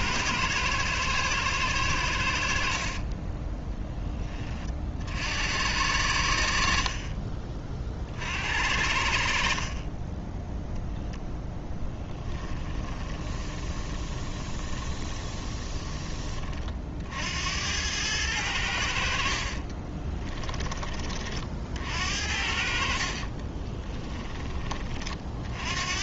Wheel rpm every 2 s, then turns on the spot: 110, 50, 30, 50, 70, 0, 20, 20, 50, 80, 20, 50, 30.
2-4 12-16